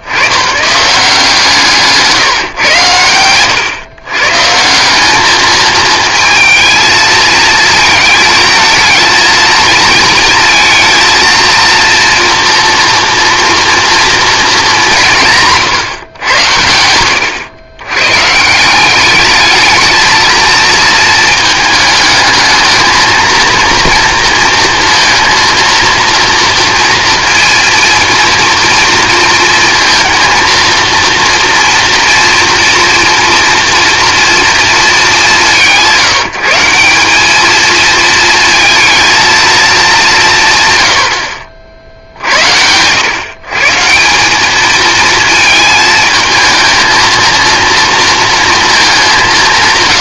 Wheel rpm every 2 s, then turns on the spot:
110, 120, 170, 220, 220, 230, 230, 210, 100, 190, 230, 220, 230, 230, 230, 230, 230, 230, 170, 230, 130, 90, 210, 220, 220.
none